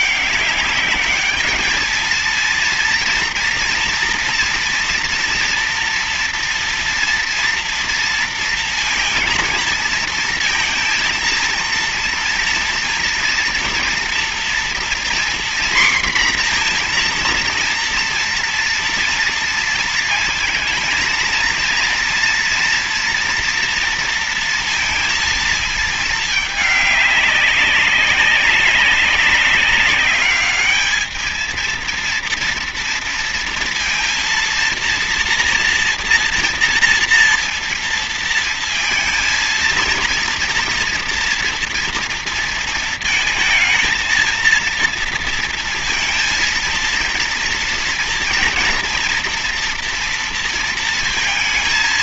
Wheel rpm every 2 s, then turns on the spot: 200, 230, 230, 230, 230, 230, 230, 240, 240, 230, 230, 230, 230, 210, 200, 210, 230, 230, 240, 230, 230, 230, 230, 230, 230, 230.
none